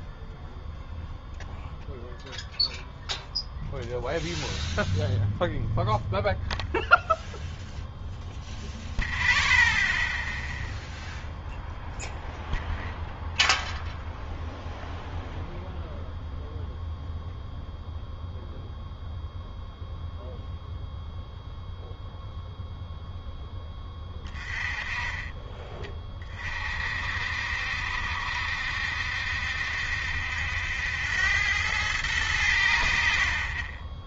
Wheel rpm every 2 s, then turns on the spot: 0, 0, 0, 0, 0, 0, 0, 0, 0, 0, 0, 0, 20, 50, 70, 80, 70.
none